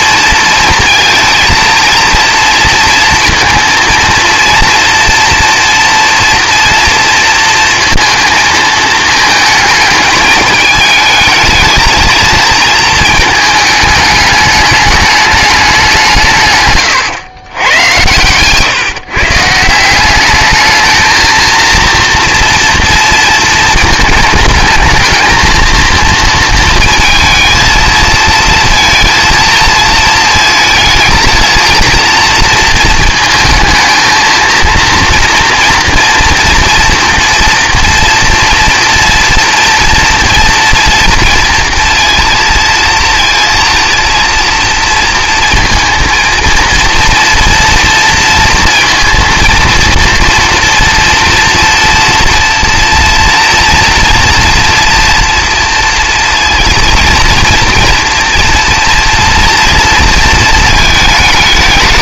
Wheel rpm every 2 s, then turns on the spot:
230, 230, 230, 230, 220, 210, 220, 210, 120, 130, 210, 230, 220, 230, 230, 220, 230, 230, 230, 240, 230, 230, 230, 230, 230, 230, 230, 240, 230, 230, 220.
16-18